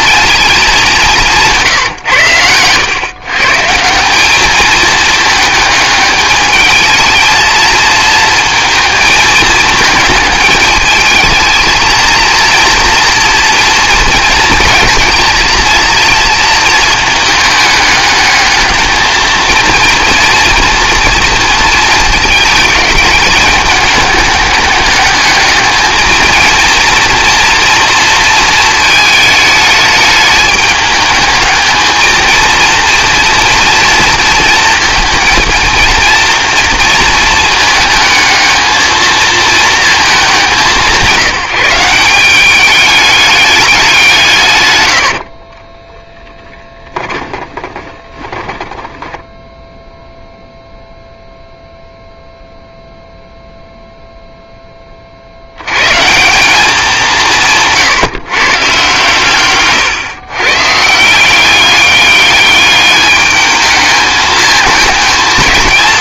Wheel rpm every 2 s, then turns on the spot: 210, 110, 210, 220, 220, 220, 230, 230, 220, 220, 230, 220, 210, 230, 220, 210, 230, 220, 230, 220, 180, 200, 110, 10, 10, 0, 0, 20, 190, 130, 140, 210, 220.
46-50